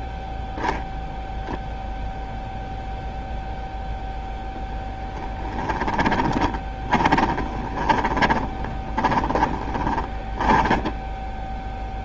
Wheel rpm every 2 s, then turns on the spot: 0, 0, 0, 20, 20, 20.
6-12